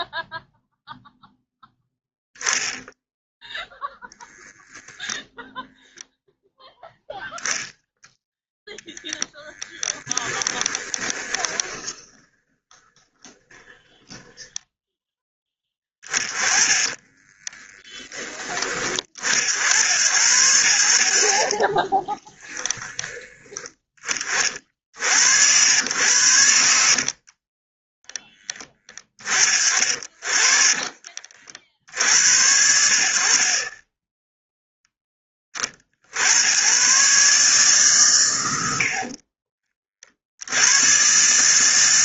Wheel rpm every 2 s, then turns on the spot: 0, 10, 10, 0, 0, 20, 20, 10, 20, 30, 70, 10, 50, 70, 20, 40, 60, 10, 130, 60, 110.
4-6 10-14 16-18 30-32